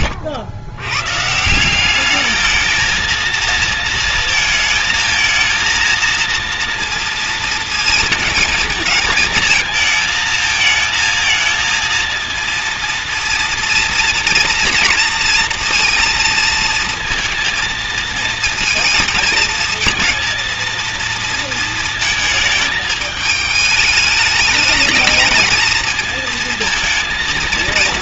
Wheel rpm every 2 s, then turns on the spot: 90, 220, 220, 230, 220, 220, 230, 230, 230, 230, 230, 220, 220, 230.
none